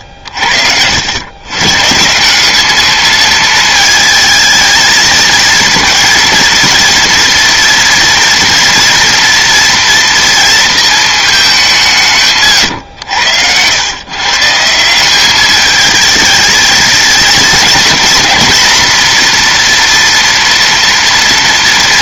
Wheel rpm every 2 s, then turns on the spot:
80, 210, 220, 230, 230, 230, 120, 170, 230, 230, 240.
none